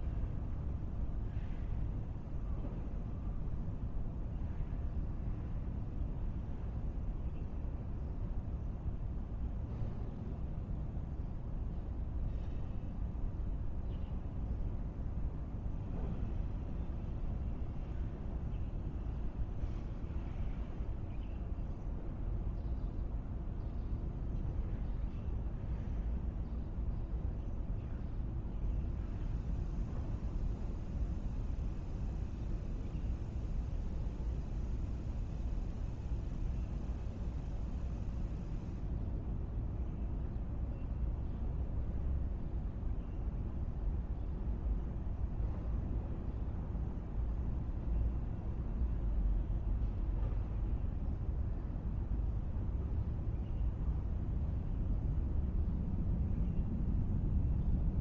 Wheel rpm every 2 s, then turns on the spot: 0, 0, 0, 0, 0, 0, 0, 0, 0, 0, 0, 0, 0, 0, 0, 0, 0, 0, 0, 0, 0, 0, 0, 0, 0, 0, 0, 0, 0.
none